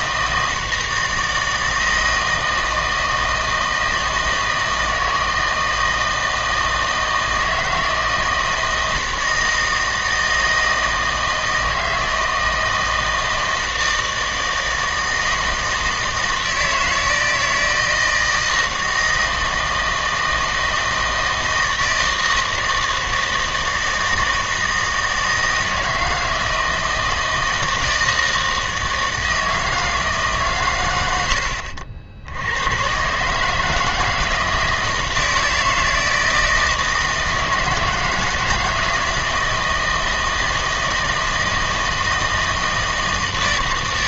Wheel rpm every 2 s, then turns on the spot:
160, 160, 160, 160, 160, 160, 160, 160, 160, 160, 160, 160, 160, 160, 160, 130, 100, 160, 160, 160, 160, 160.
none